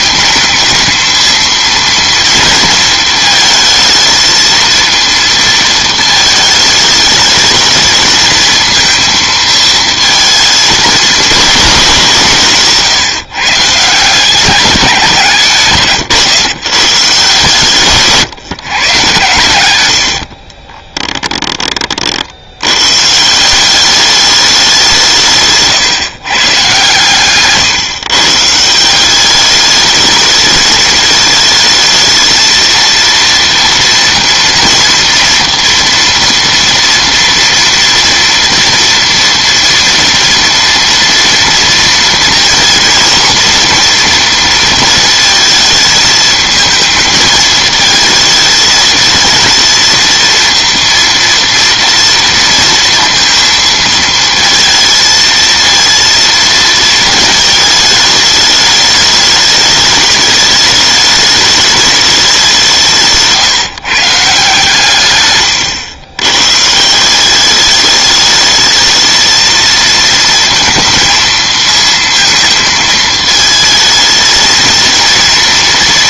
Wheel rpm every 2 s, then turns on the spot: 220, 230, 230, 210, 220, 220, 150, 190, 130, 120, 20, 110, 180, 140, 160, 220, 230, 230, 230, 230, 230, 230, 230, 220, 220, 230, 230, 230, 230, 210, 210, 170, 150, 150, 220, 230, 220, 220.
20-22